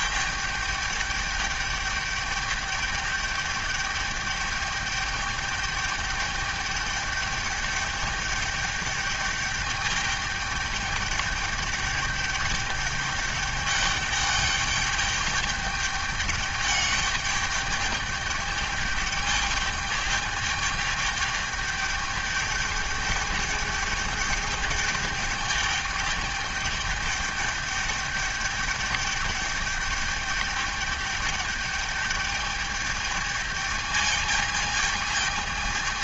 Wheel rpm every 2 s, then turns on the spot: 210, 210, 210, 210, 210, 210, 210, 210, 200, 210, 210, 210, 210, 210, 210, 210, 210, 220.
none